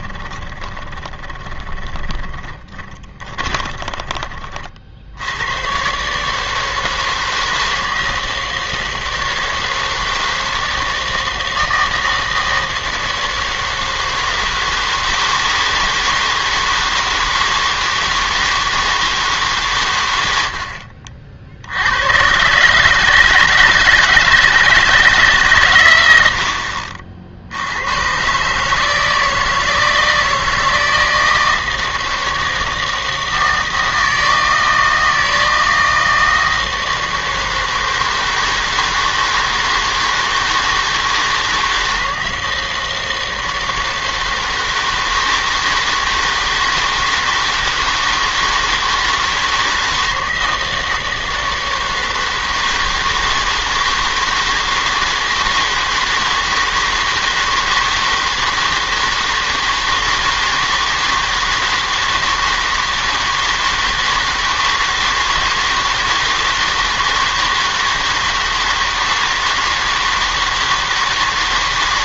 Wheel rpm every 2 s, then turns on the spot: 20, 20, 40, 160, 160, 160, 160, 160, 160, 160, 70, 130, 170, 70, 140, 160, 160, 160, 160, 160, 160, 160, 160, 160, 160, 160, 160, 160, 160, 160, 160, 160, 160, 160, 160, 160.
0-4